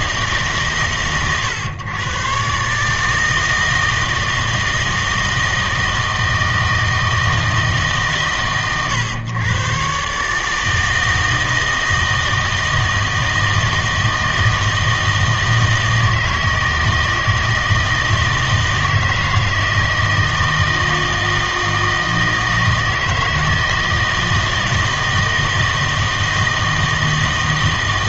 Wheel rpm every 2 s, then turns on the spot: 150, 140, 160, 160, 110, 160, 160, 160, 160, 160, 160, 160, 160, 160.
none